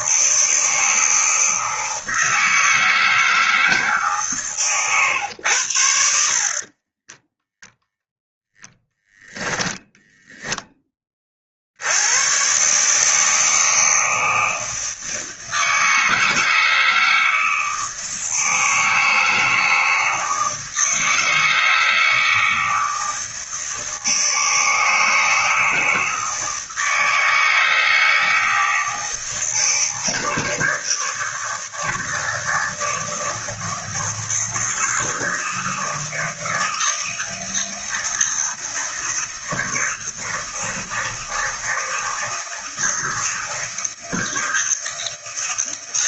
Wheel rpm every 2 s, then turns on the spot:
160, 160, 130, 30, 0, 20, 140, 160, 160, 160, 160, 160, 160, 160, 160, 160, 160, 160, 160, 160, 160, 160, 160.
6-8